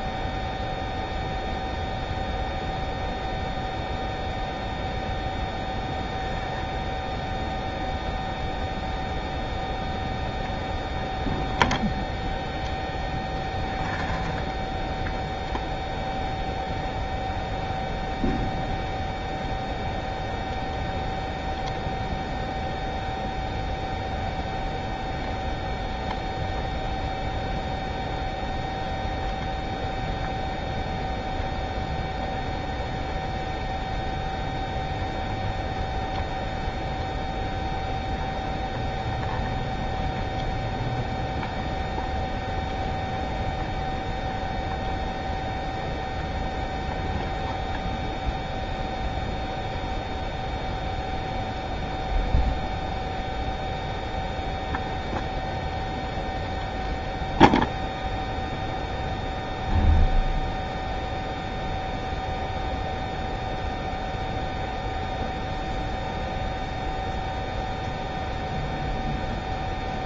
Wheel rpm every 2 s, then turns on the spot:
0, 0, 0, 0, 0, 0, 0, 0, 0, 0, 0, 0, 0, 0, 0, 0, 0, 0, 0, 0, 0, 0, 0, 0, 0, 0, 0, 0, 0, 0, 0, 0, 0, 0, 0.
none